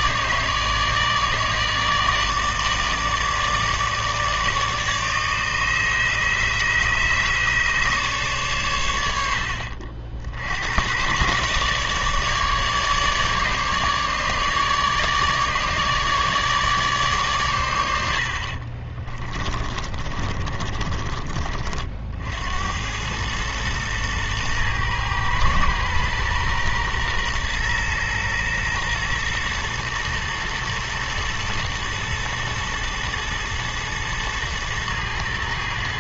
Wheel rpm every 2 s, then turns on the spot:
150, 160, 150, 150, 110, 90, 150, 150, 150, 40, 30, 80, 110, 120, 120, 110, 110, 110.
18-22